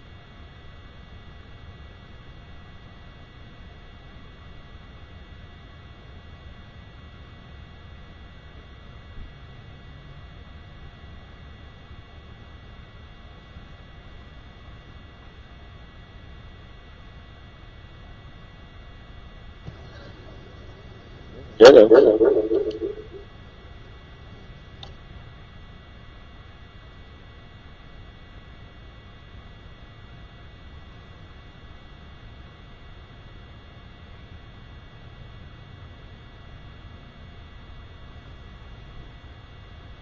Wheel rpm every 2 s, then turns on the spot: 0, 0, 0, 0, 0, 0, 0, 0, 0, 0, 0, 0, 0, 0, 0, 0, 0, 0, 0, 0.
none